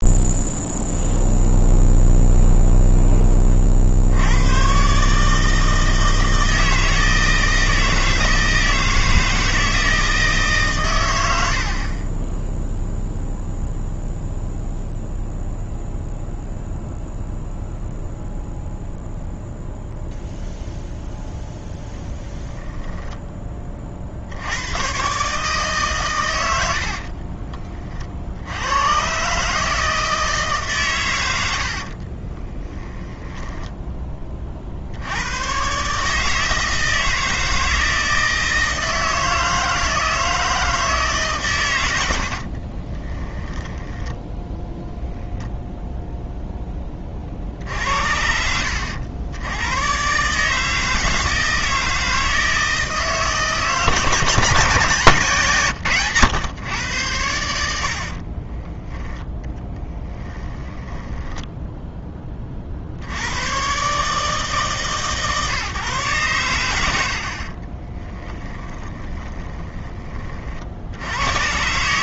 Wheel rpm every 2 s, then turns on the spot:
0, 0, 100, 160, 160, 160, 0, 0, 0, 0, 0, 0, 60, 110, 60, 150, 20, 30, 150, 160, 160, 60, 10, 0, 60, 140, 160, 170, 130, 40, 10, 30, 150, 100, 30, 40.
32-34 42-46 58-62 68-70